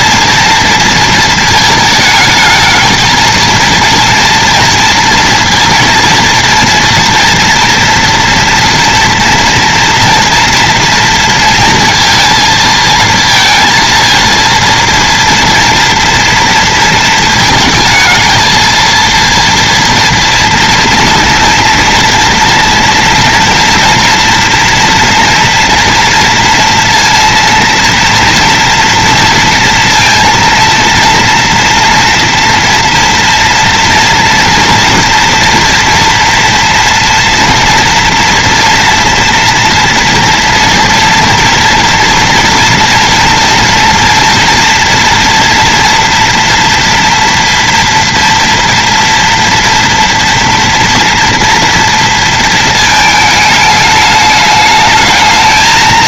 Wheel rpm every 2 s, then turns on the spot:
230, 220, 230, 230, 230, 230, 220, 230, 230, 230, 230, 230, 230, 230, 240, 230, 230, 230, 230, 230, 230, 240, 230, 230, 230, 230, 220, 210.
none